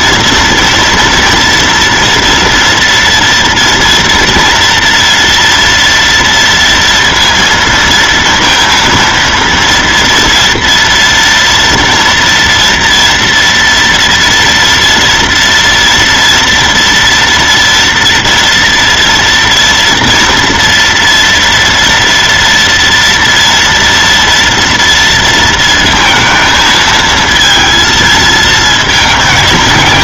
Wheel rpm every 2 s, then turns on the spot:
230, 230, 230, 230, 230, 230, 230, 230, 230, 230, 230, 230, 230, 220, 220.
none